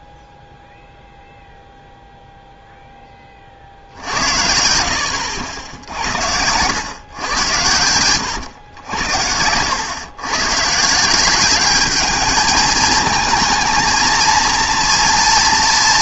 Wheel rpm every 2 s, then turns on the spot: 0, 0, 70, 90, 100, 140, 220, 230.
none